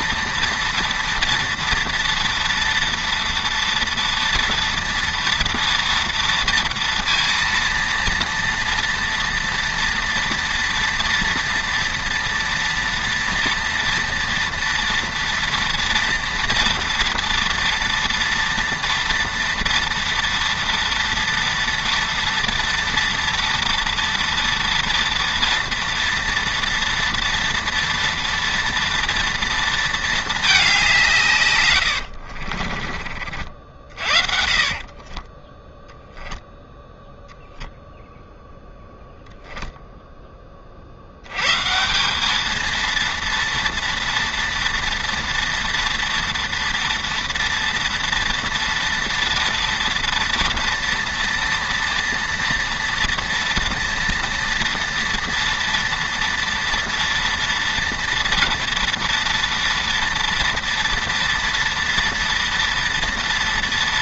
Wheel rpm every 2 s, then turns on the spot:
230, 230, 230, 230, 230, 230, 230, 230, 230, 230, 230, 230, 240, 230, 230, 200, 40, 40, 0, 0, 40, 220, 230, 230, 240, 230, 230, 230, 230, 230, 230, 230.
32-36